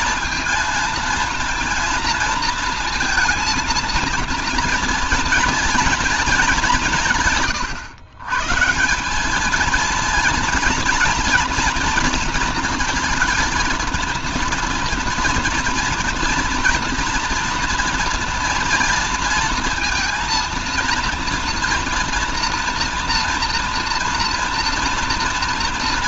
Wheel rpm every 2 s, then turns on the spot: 230, 230, 230, 210, 140, 230, 230, 230, 230, 230, 230, 230, 230.
none